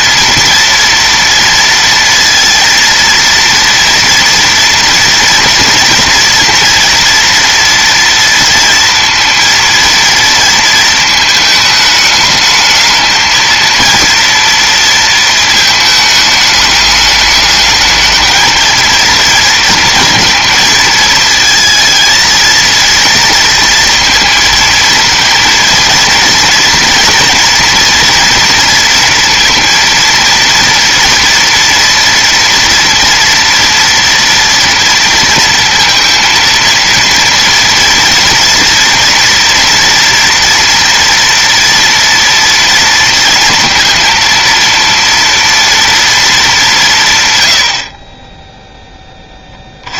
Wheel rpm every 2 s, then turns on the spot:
230, 230, 230, 230, 230, 230, 220, 230, 210, 220, 220, 220, 220, 230, 230, 230, 230, 230, 230, 230, 230, 230, 230, 170, 0.
none